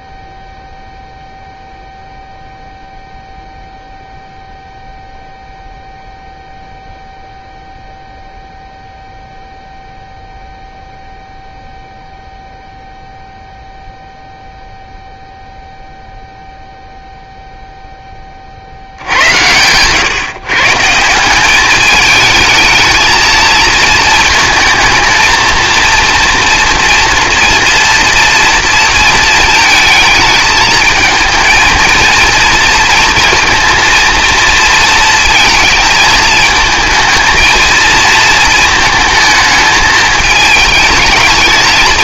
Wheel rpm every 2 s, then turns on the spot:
0, 0, 0, 0, 0, 0, 0, 0, 0, 60, 150, 220, 230, 230, 230, 220, 230, 230, 220, 220, 210.
none